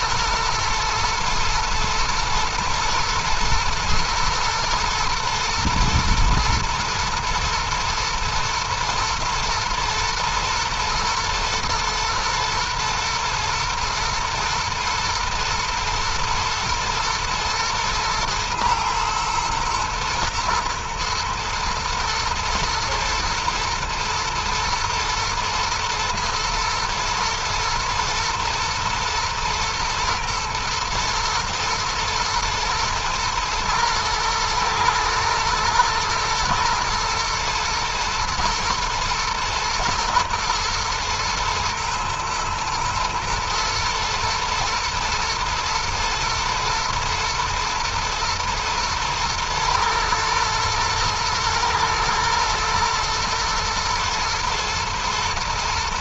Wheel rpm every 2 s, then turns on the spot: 110, 110, 120, 120, 110, 110, 110, 110, 120, 110, 120, 110, 110, 120, 110, 110, 120, 110, 120, 120, 110, 110, 120, 120, 110, 110, 120, 110.
none